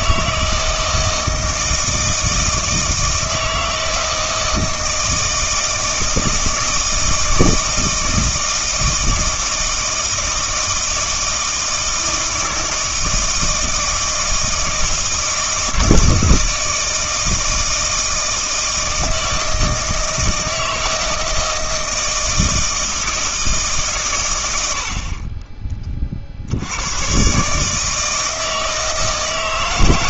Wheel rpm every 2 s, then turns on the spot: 160, 160, 160, 160, 160, 160, 160, 160, 160, 160, 160, 160, 80, 80, 160.
none